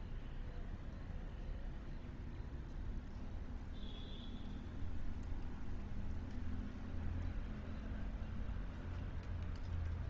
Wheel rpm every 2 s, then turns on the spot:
0, 0, 0, 0, 0.
none